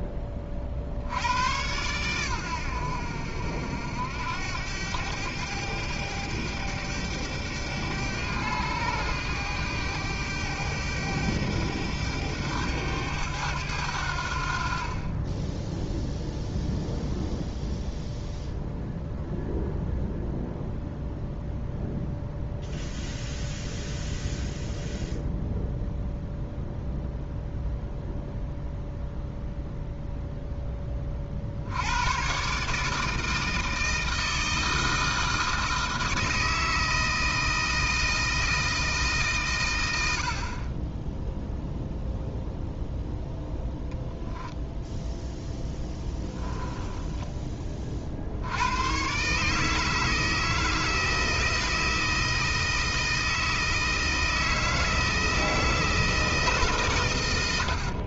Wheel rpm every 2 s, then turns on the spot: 50, 80, 100, 100, 100, 100, 100, 40, 0, 0, 0, 0, 0, 0, 0, 10, 150, 160, 160, 160, 30, 0, 0, 30, 110, 160, 160, 160, 140.
46-48